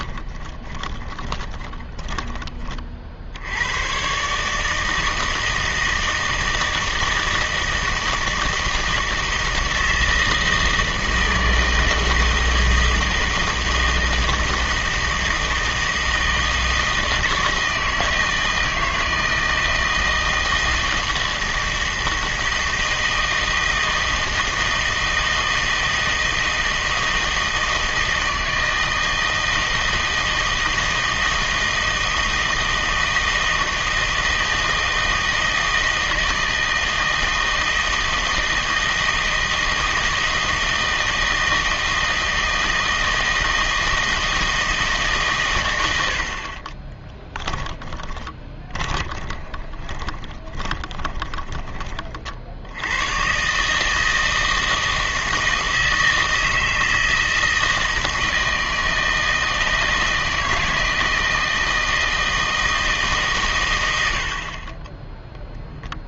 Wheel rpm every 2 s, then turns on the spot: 10, 30, 160, 160, 160, 160, 160, 160, 160, 160, 160, 160, 160, 160, 160, 160, 160, 160, 160, 160, 160, 170, 160, 40, 20, 30, 80, 160, 160, 160, 160, 160, 20.
0-2 46-52 64-66